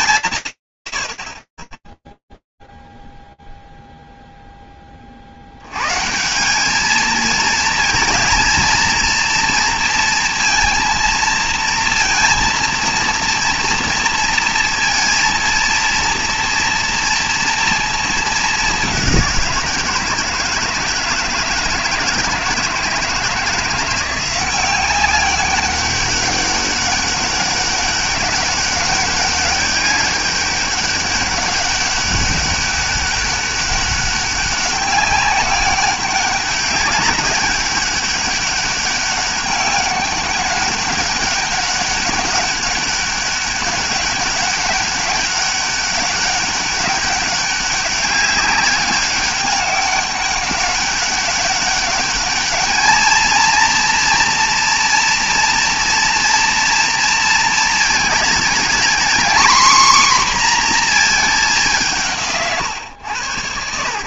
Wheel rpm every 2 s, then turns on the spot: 180, 0, 0, 170, 220, 230, 240, 230, 230, 210, 160, 160, 180, 200, 200, 200, 200, 200, 200, 200, 200, 200, 200, 200, 200, 190, 210, 240, 230, 230, 250, 130.
none